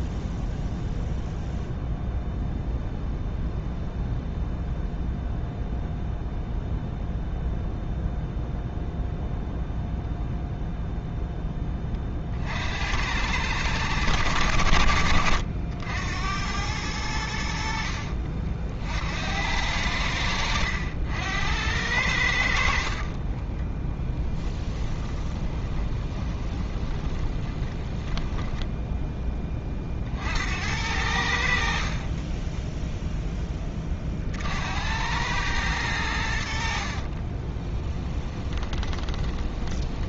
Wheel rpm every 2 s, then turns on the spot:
0, 0, 0, 0, 0, 0, 50, 80, 90, 40, 80, 60, 10, 20, 10, 70, 10, 70, 70, 20.
22-30 32-34 38-40